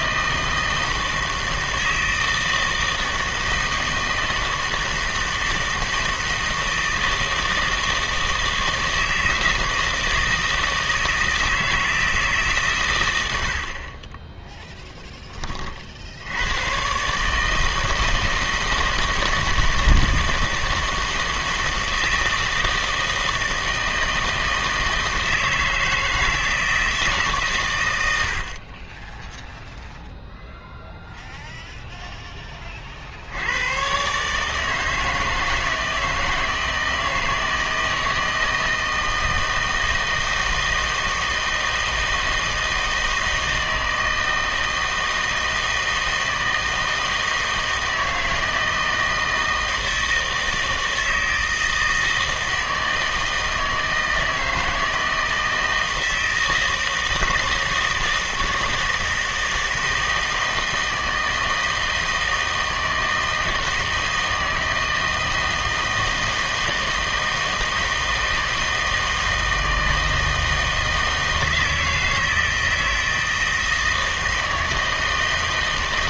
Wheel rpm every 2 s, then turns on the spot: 160, 160, 160, 160, 160, 160, 140, 0, 110, 160, 160, 160, 160, 160, 50, 0, 20, 150, 160, 160, 160, 160, 160, 160, 160, 160, 160, 160, 160, 160, 160, 160, 160, 160, 160, 160, 160, 160.
none